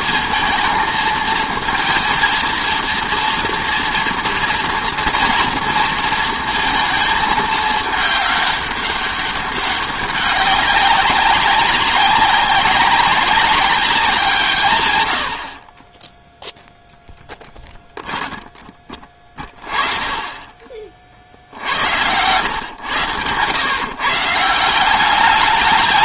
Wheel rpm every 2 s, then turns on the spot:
230, 230, 230, 230, 200, 190, 190, 130, 0, 10, 30, 110, 170.
none